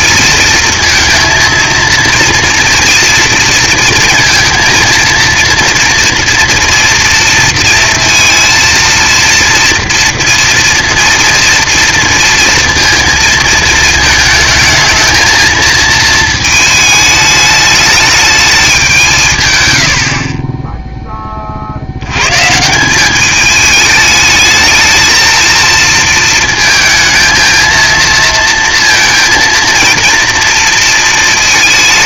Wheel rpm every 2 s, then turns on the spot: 230, 230, 230, 240, 230, 230, 230, 220, 220, 200, 10, 160, 220, 230, 230, 230.
none